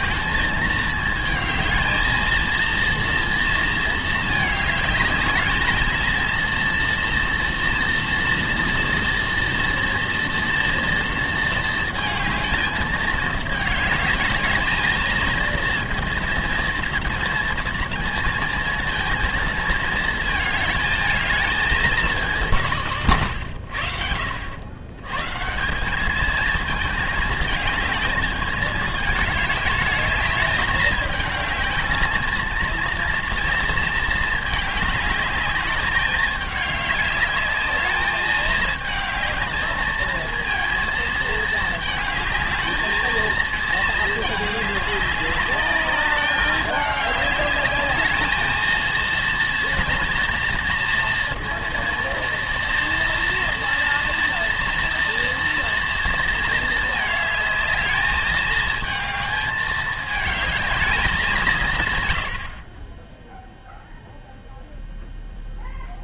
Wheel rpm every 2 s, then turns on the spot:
220, 230, 210, 230, 230, 230, 220, 220, 230, 220, 220, 150, 130, 220, 210, 220, 230, 210, 210, 220, 220, 220, 200, 200, 230, 230, 230, 230, 220, 220, 200, 10, 0.
none